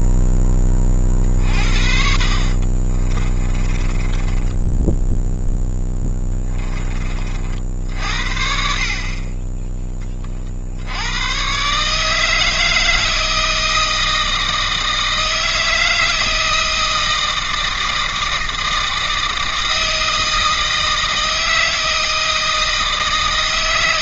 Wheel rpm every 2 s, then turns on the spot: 30, 30, 0, 30, 50, 100, 160, 160, 160, 160, 160, 160.
0-4